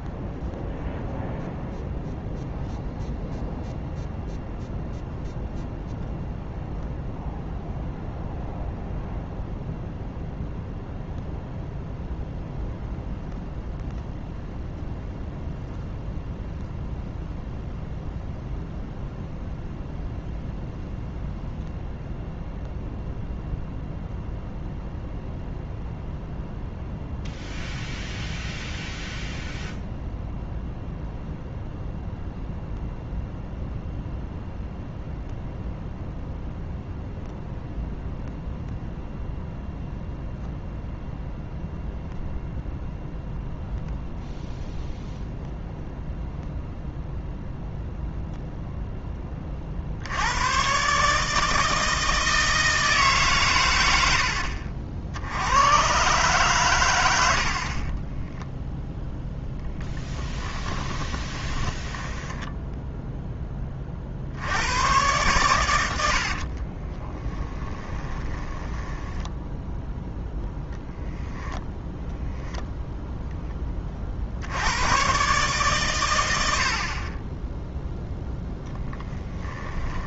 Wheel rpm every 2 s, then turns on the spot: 0, 0, 0, 0, 0, 0, 0, 0, 0, 0, 0, 0, 0, 0, 0, 0, 0, 0, 0, 0, 0, 0, 0, 0, 0, 120, 160, 60, 110, 0, 10, 0, 110, 30, 10, 0, 0, 100, 50, 10.
60-62 66-70 78-80